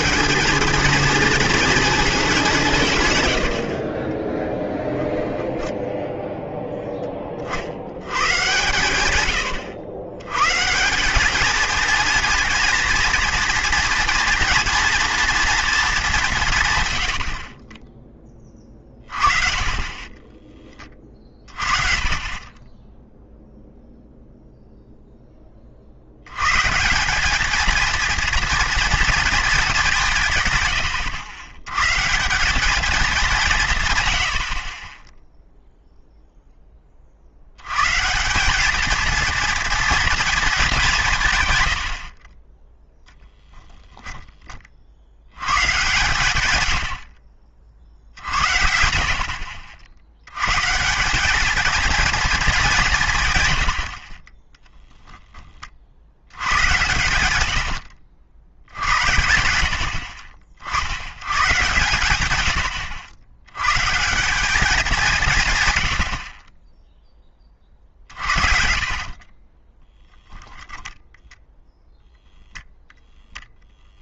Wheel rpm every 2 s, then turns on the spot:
220, 180, 10, 0, 120, 140, 230, 230, 150, 30, 20, 20, 0, 140, 230, 110, 200, 40, 20, 210, 210, 10, 30, 100, 60, 140, 190, 10, 110, 80, 50, 90, 200, 20, 40, 0, 0.
42-44 46-48 54-60 68-70